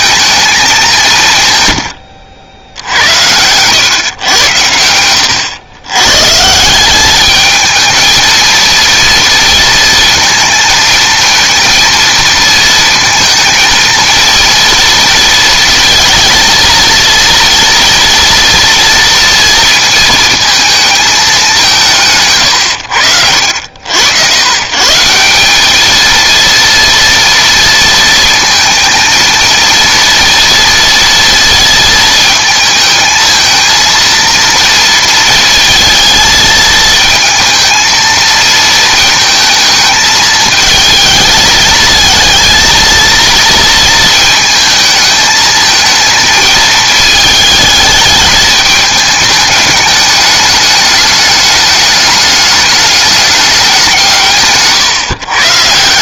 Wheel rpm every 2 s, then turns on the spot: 210, 70, 100, 160, 230, 230, 230, 230, 230, 230, 220, 100, 140, 230, 220, 230, 220, 230, 220, 220, 220, 230, 220, 220, 220, 210, 210, 140.
54-56